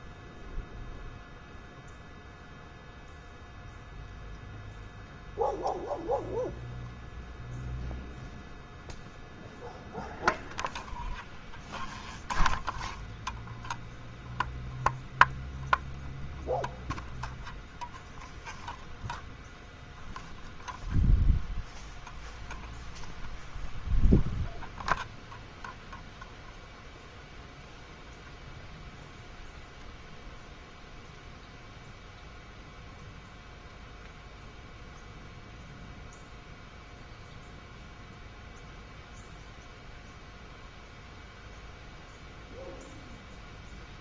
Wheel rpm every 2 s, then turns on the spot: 0, 0, 0, 0, 0, 0, 0, 0, 0, 0, 0, 0, 0, 0, 0, 0, 0, 0, 0, 0, 0, 0.
none